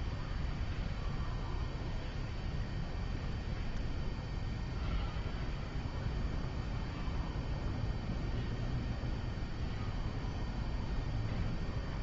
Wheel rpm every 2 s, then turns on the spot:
0, 0, 0, 0, 0, 0.
none